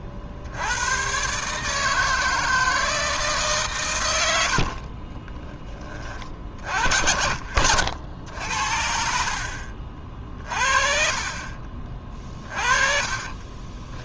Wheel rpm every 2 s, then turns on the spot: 80, 160, 70, 50, 70, 40, 30.
4-6 10-14